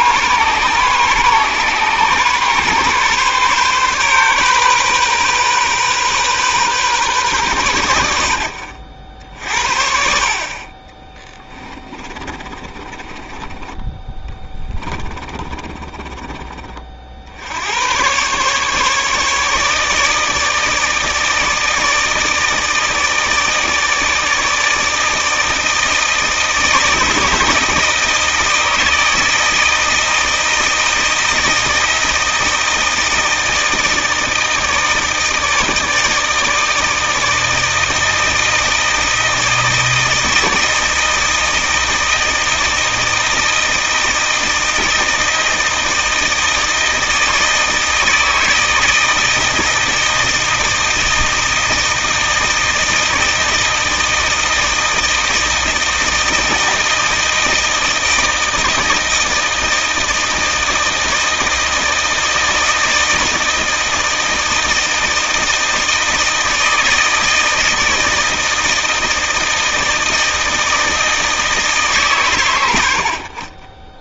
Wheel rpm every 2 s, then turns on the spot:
130, 140, 130, 130, 50, 20, 30, 20, 40, 140, 160, 160, 160, 160, 160, 160, 160, 160, 160, 160, 160, 160, 160, 160, 160, 160, 160, 160, 160, 160, 160, 160, 160, 160, 160, 160, 70.
12-16